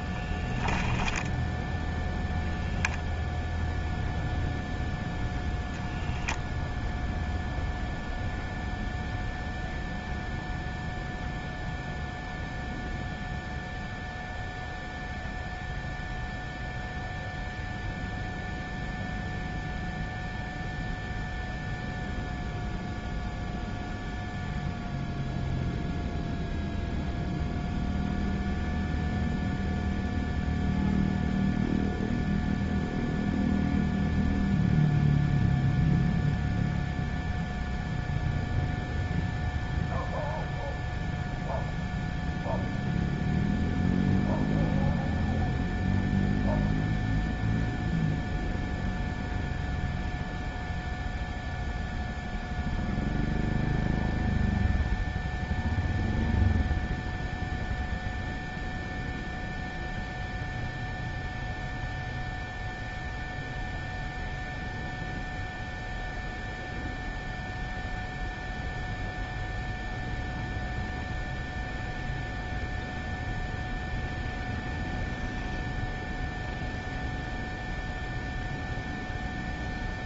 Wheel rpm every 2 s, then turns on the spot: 0, 0, 0, 0, 0, 0, 0, 0, 0, 0, 0, 0, 0, 0, 0, 0, 0, 0, 0, 0, 0, 0, 0, 0, 0, 0, 0, 0, 0, 0, 0, 0, 0, 0, 0, 0, 0, 0, 0, 0.
none